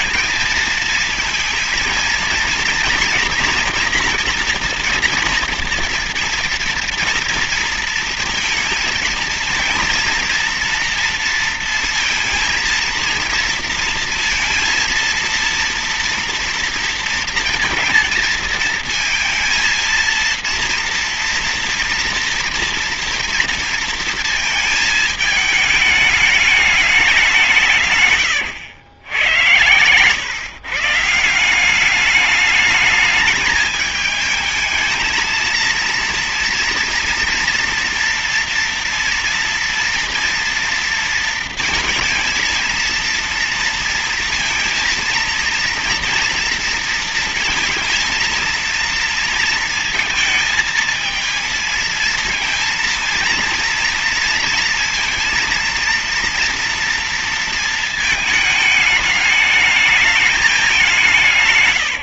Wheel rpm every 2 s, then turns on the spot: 220, 230, 240, 230, 230, 230, 230, 230, 230, 230, 230, 230, 220, 210, 110, 130, 210, 220, 230, 240, 230, 230, 230, 230, 230, 220, 230, 230, 230, 210, 200.
none